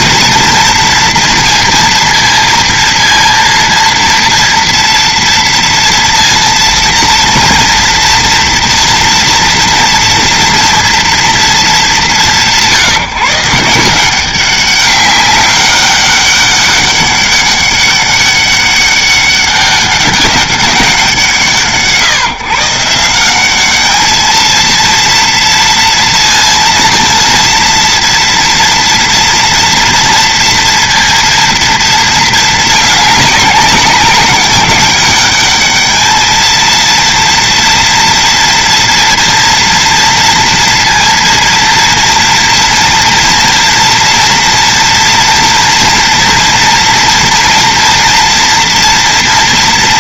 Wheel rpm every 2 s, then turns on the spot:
230, 230, 230, 230, 230, 230, 160, 190, 200, 200, 190, 150, 230, 230, 240, 230, 210, 200, 230, 230, 230, 230, 230, 230, 230.
none